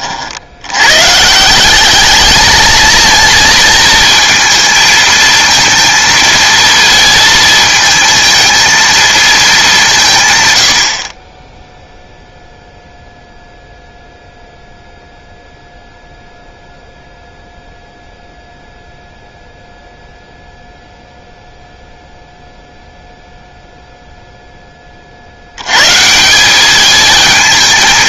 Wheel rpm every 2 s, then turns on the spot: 100, 220, 220, 230, 230, 90, 0, 0, 0, 0, 0, 0, 20, 210.
none